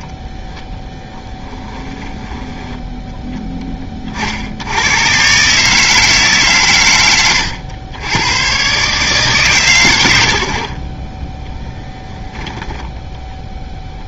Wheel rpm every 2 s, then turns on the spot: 0, 10, 90, 120, 130, 40, 10.
none